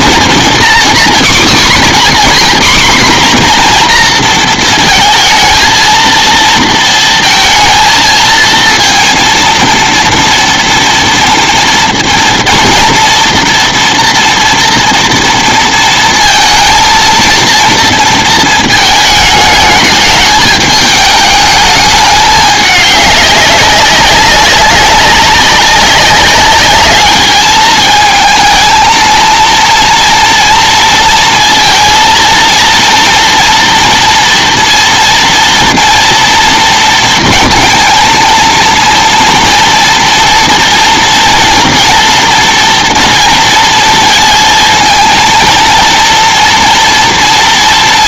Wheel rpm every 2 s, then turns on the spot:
240, 260, 230, 230, 230, 230, 230, 230, 230, 220, 210, 200, 190, 200, 220, 230, 230, 230, 230, 230, 230, 240, 230, 230.
none